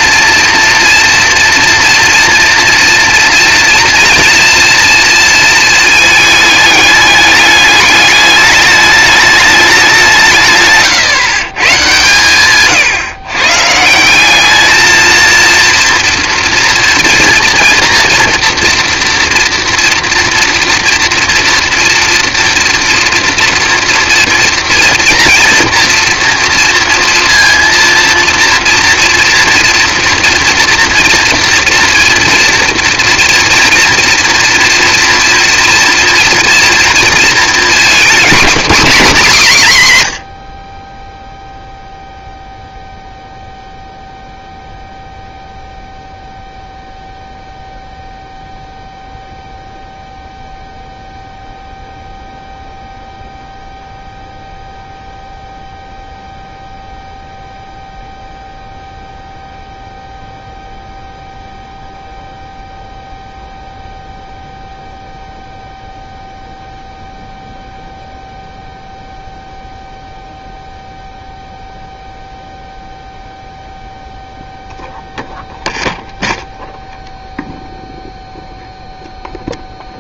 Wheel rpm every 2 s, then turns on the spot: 230, 230, 230, 210, 210, 140, 130, 220, 230, 230, 230, 230, 230, 230, 230, 230, 230, 240, 230, 250, 10, 0, 0, 0, 0, 0, 0, 0, 0, 0, 0, 0, 0, 0, 0, 0, 0, 0, 0, 0.
none